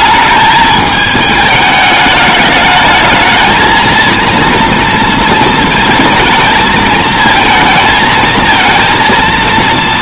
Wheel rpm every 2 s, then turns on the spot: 210, 220, 230, 220, 230.
none